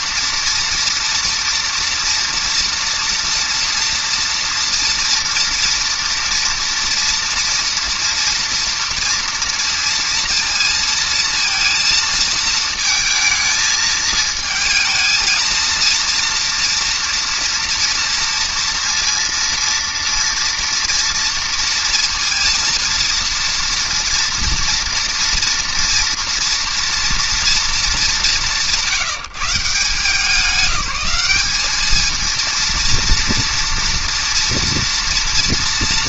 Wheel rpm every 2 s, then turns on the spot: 230, 230, 230, 230, 230, 230, 220, 230, 240, 230, 230, 230, 230, 230, 180, 200, 230, 230.
none